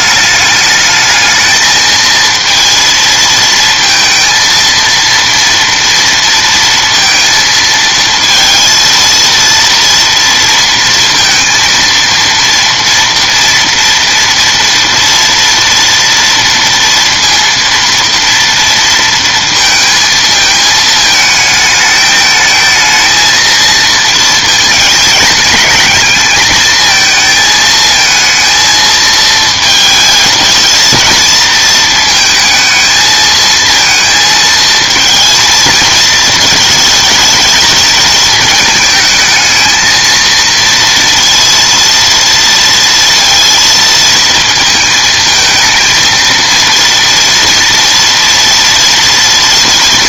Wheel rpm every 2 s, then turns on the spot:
210, 230, 230, 230, 230, 230, 230, 230, 230, 230, 220, 220, 220, 220, 220, 220, 220, 220, 220, 220, 230, 230, 220, 230, 230.
none